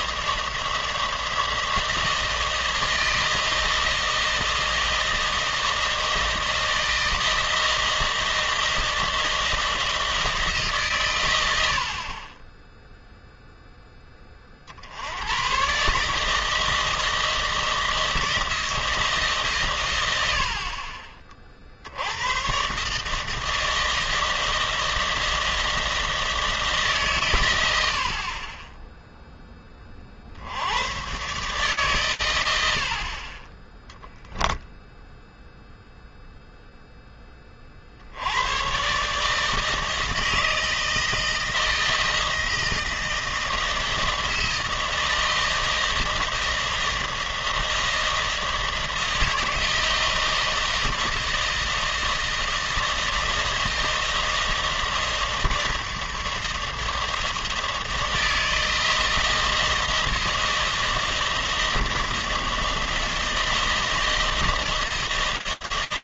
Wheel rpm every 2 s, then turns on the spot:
160, 160, 160, 160, 160, 110, 0, 100, 160, 150, 50, 160, 160, 120, 10, 130, 40, 0, 20, 150, 160, 160, 160, 160, 160, 160, 160, 160, 160, 160, 160, 160, 160.
none